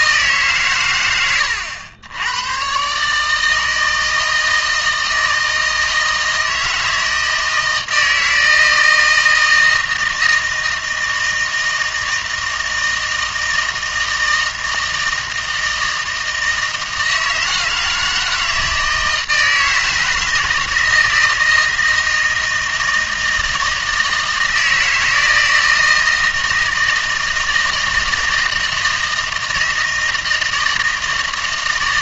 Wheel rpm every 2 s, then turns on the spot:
130, 130, 160, 160, 160, 160, 160, 160, 160, 160, 160, 160, 160, 160, 160, 160.
none